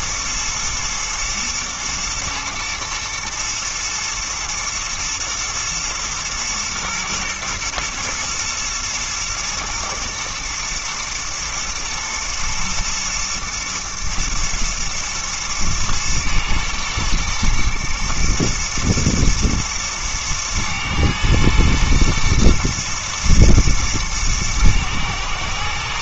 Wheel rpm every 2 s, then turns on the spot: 110, 120, 110, 110, 120, 120, 120, 120, 120, 120, 120, 120, 110.
none